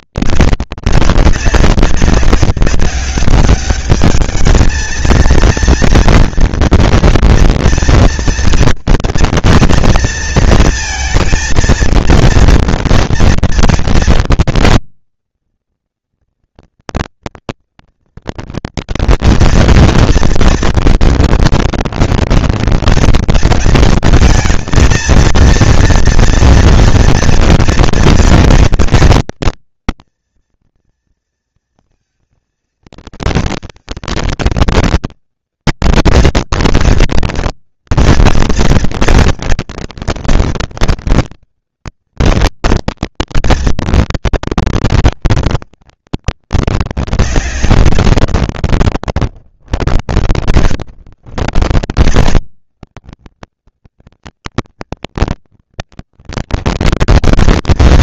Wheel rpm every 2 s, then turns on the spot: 190, 200, 220, 230, 230, 230, 230, 230, 230, 230, 230, 230, 220, 230, 220, 230, 230, 230, 220, 230, 230, 230, 230, 200, 140, 90, 180, 220, 230.
50-52